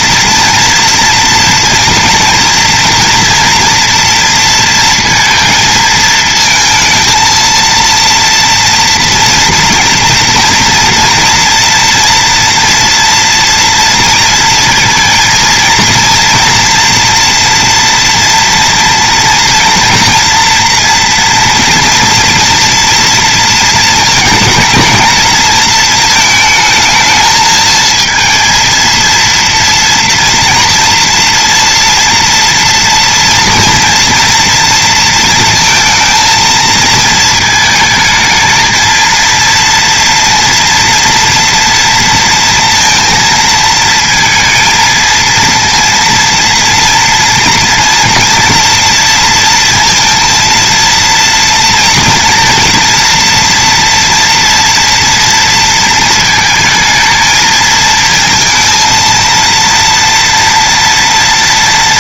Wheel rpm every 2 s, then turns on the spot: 230, 230, 230, 230, 230, 230, 240, 230, 230, 230, 230, 240, 230, 220, 230, 230, 230, 230, 230, 220, 230, 230, 230, 230, 230, 230, 230, 240, 220, 230, 230.
none